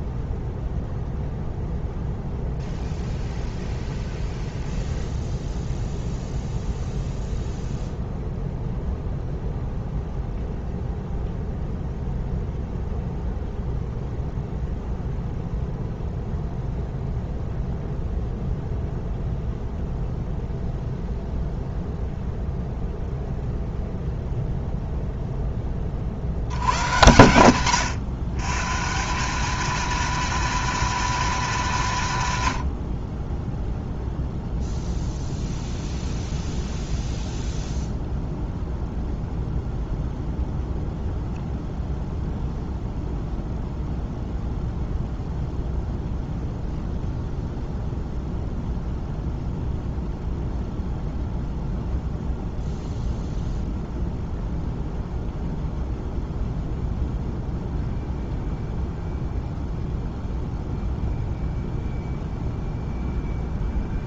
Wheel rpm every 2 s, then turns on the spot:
0, 0, 0, 0, 0, 0, 0, 0, 0, 0, 0, 0, 0, 90, 150, 230, 80, 0, 0, 0, 0, 0, 0, 0, 0, 0, 0, 0, 0, 0, 0, 0.
none